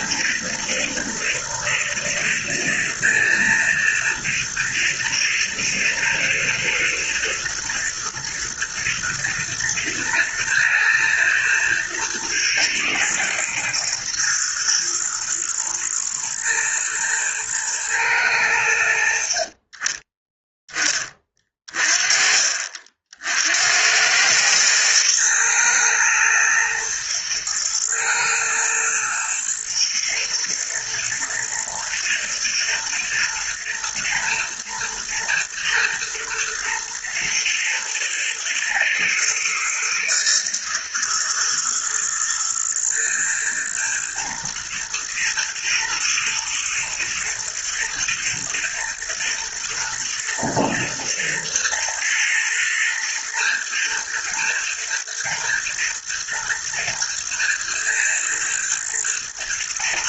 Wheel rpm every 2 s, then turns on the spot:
110, 120, 110, 110, 110, 110, 110, 120, 110, 90, 10, 50, 110, 110, 110, 110, 110, 110, 120, 120, 110, 110, 120, 110, 120, 110, 120, 120, 120, 110.
none